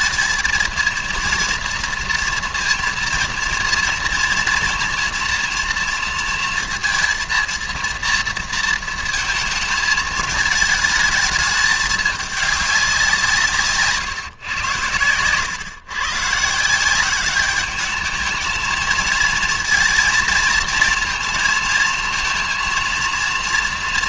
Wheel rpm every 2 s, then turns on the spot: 230, 230, 230, 230, 230, 220, 200, 110, 160, 220, 230, 230.
none